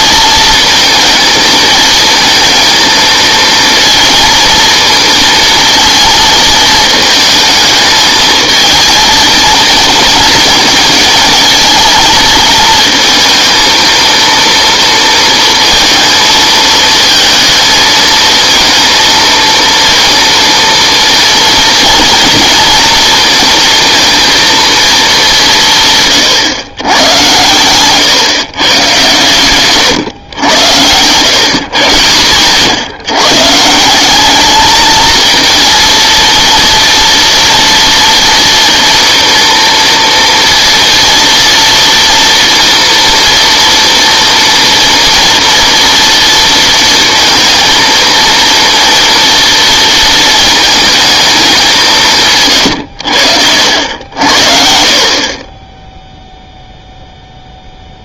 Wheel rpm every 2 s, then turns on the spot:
230, 220, 230, 220, 220, 220, 230, 230, 230, 230, 230, 230, 230, 130, 130, 100, 130, 210, 230, 240, 230, 230, 230, 230, 230, 220, 130, 60, 0.
none